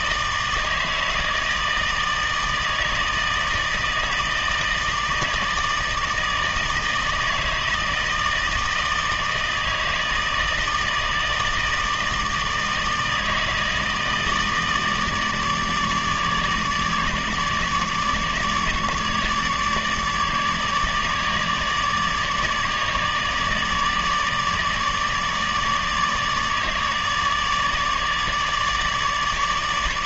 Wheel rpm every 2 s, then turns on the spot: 160, 160, 160, 160, 160, 160, 160, 160, 150, 150, 150, 150, 150, 150, 150.
none